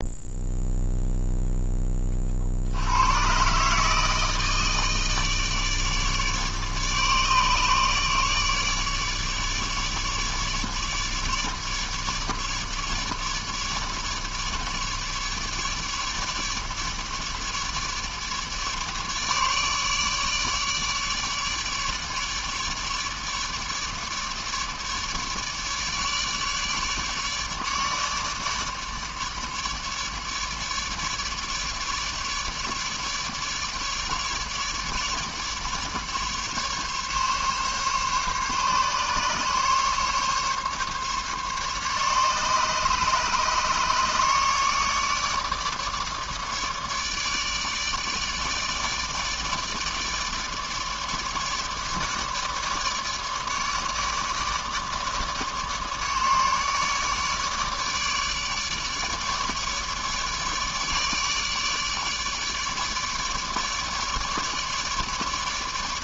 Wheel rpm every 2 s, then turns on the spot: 0, 60, 160, 150, 150, 150, 150, 150, 150, 150, 150, 150, 150, 150, 150, 150, 150, 150, 150, 140, 140, 150, 150, 150, 150, 150, 150, 150, 150, 150, 150, 150, 150.
none